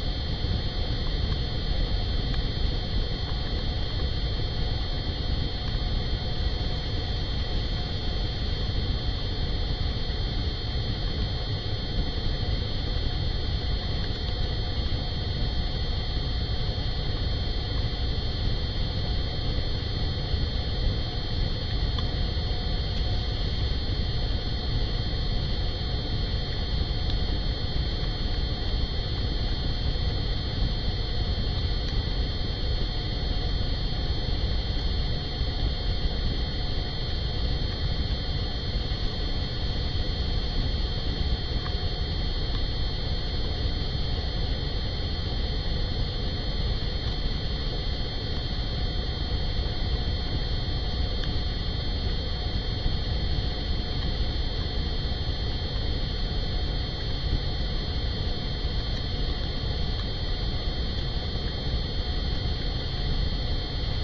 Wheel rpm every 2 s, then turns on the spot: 0, 0, 0, 0, 0, 0, 0, 0, 0, 0, 0, 0, 0, 0, 0, 0, 0, 0, 0, 0, 0, 0, 0, 0, 0, 0, 0, 0, 0, 0, 0, 0.
none